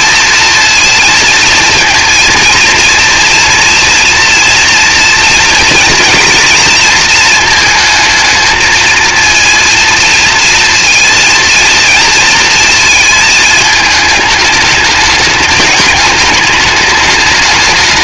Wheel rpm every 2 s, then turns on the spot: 230, 230, 230, 230, 230, 230, 220, 210, 210.
none